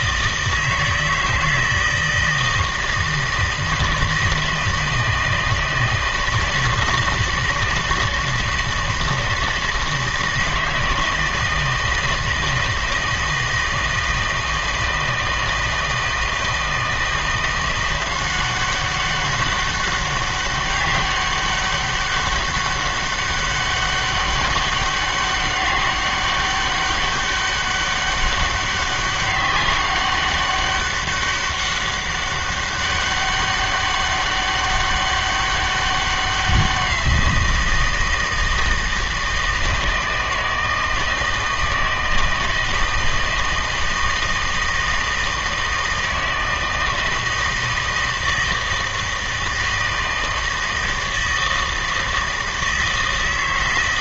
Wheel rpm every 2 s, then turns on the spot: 160, 160, 160, 160, 160, 160, 160, 160, 160, 190, 200, 200, 200, 200, 200, 200, 200, 200, 180, 160, 160, 160, 160, 160, 160, 160, 160.
none